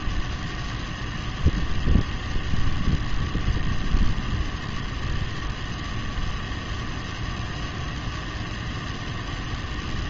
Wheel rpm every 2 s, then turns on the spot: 0, 0, 0, 0, 0.
none